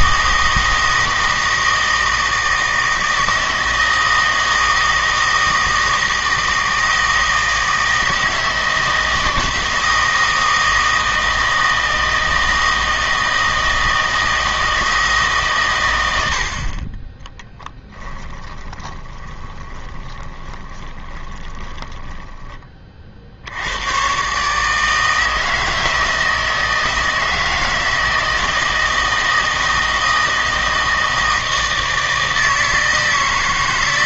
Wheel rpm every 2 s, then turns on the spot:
160, 160, 160, 160, 160, 160, 160, 160, 40, 20, 10, 30, 150, 160, 160, 160, 160.
18-22